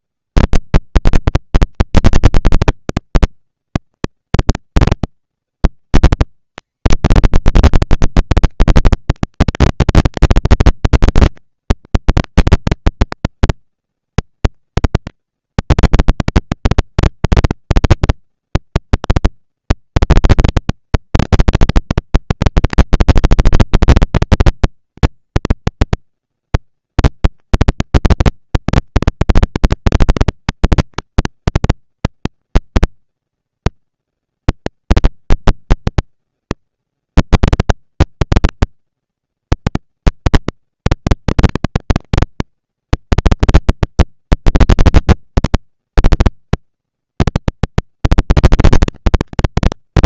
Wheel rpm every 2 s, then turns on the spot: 110, 190, 200, 160, 240, 230, 230, 220, 230, 230, 230, 230, 230, 230, 230, 230, 230, 220, 200, 210, 230, 240, 230, 230, 230.
none